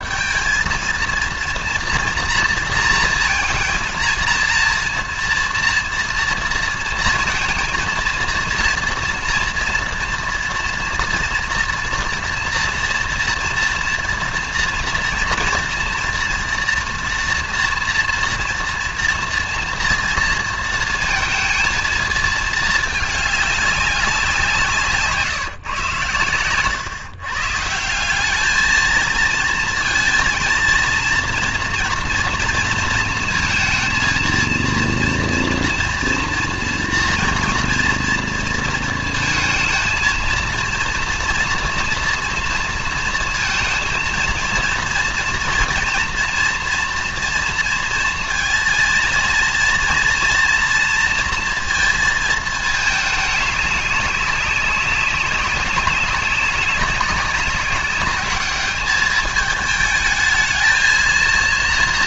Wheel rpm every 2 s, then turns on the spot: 230, 230, 230, 230, 230, 230, 230, 240, 230, 230, 230, 220, 160, 120, 220, 230, 230, 230, 230, 230, 230, 230, 230, 240, 230, 230, 220, 200, 200, 210, 220.
none